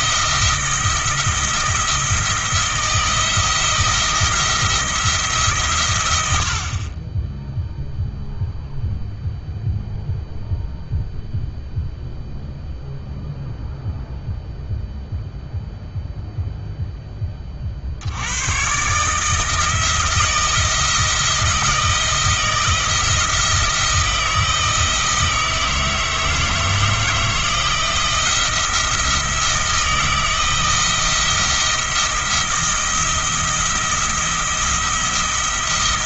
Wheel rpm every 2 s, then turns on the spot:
170, 170, 170, 40, 0, 0, 0, 0, 10, 140, 170, 170, 160, 160, 170, 160, 170, 170.
none